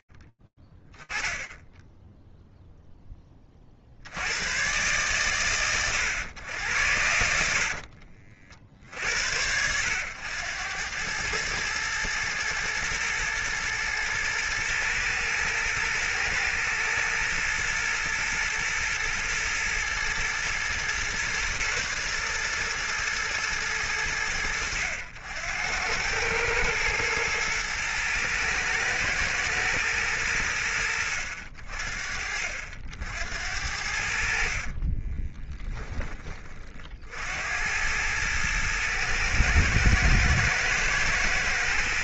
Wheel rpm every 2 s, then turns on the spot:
10, 10, 130, 90, 70, 100, 120, 120, 120, 110, 120, 120, 90, 110, 110, 80, 70, 20, 80, 110, 120.
34-36